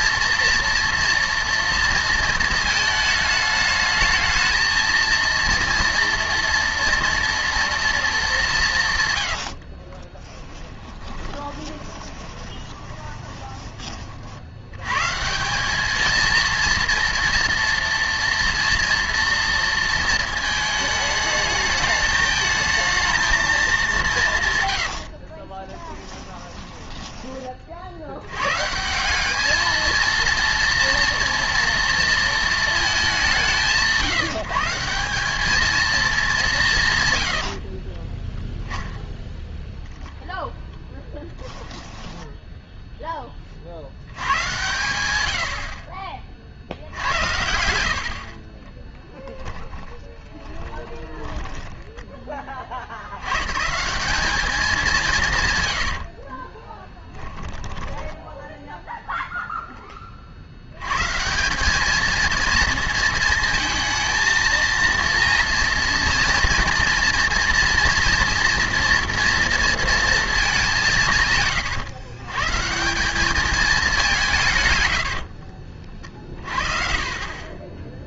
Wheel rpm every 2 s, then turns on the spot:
230, 220, 220, 230, 160, 20, 20, 110, 230, 230, 220, 220, 120, 20, 160, 230, 210, 190, 160, 0, 0, 10, 110, 70, 20, 20, 60, 200, 30, 0, 100, 230, 230, 230, 240, 180, 170, 100, 40.
10-14 24-28 48-52 56-58